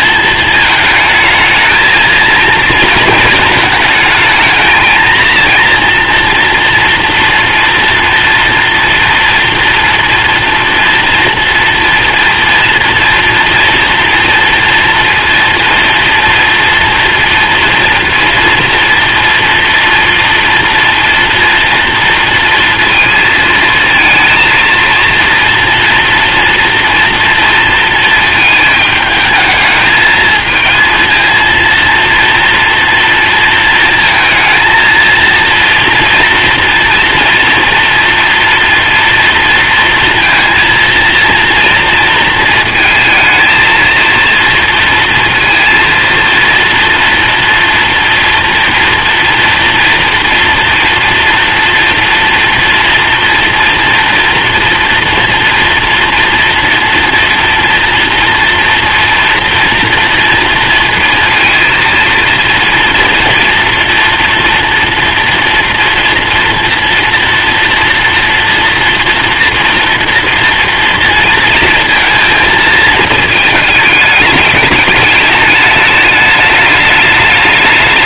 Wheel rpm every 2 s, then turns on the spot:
220, 220, 220, 240, 230, 230, 230, 230, 230, 230, 230, 230, 230, 230, 220, 220, 230, 230, 230, 230, 230, 220, 230, 230, 230, 230, 230, 230, 230, 230, 240, 230, 230, 230, 230, 230, 230, 210, 210.
none